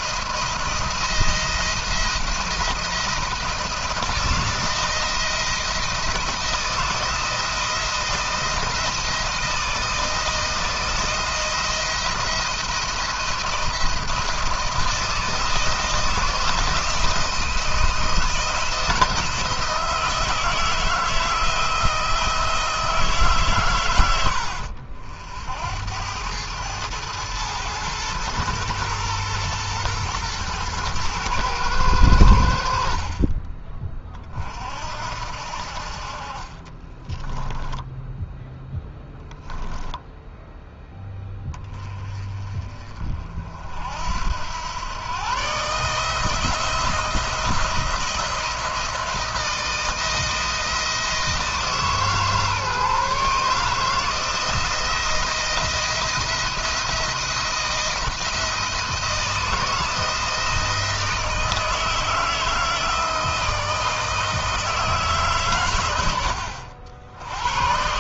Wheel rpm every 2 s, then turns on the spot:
170, 170, 160, 170, 170, 170, 170, 170, 160, 170, 160, 160, 80, 100, 110, 120, 70, 50, 20, 0, 10, 30, 100, 170, 170, 170, 150, 170, 170, 160, 170, 160, 160, 70.
36-38